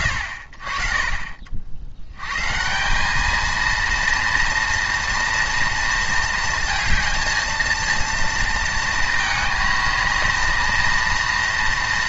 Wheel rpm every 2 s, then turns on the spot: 40, 170, 230, 230, 230, 230.
none